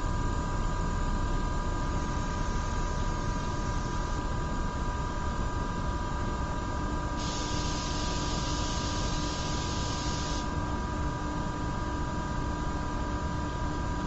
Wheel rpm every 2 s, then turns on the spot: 0, 0, 0, 0, 0, 0, 0.
none